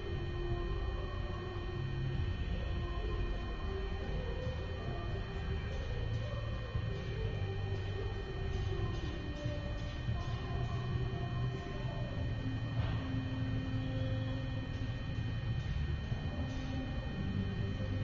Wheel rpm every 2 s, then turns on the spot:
0, 0, 0, 0, 0, 0, 0, 0, 0.
none